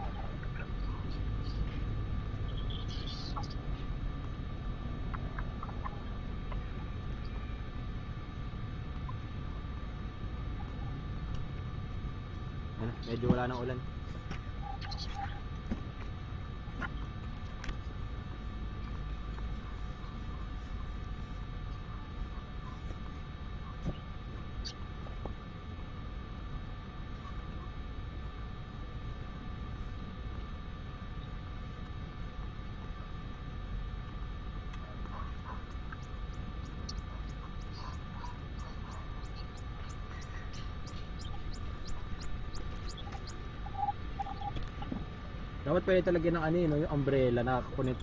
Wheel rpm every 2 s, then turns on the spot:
0, 0, 0, 0, 0, 0, 0, 0, 0, 0, 0, 0, 0, 0, 0, 0, 0, 0, 0, 0, 0, 0, 0, 0.
none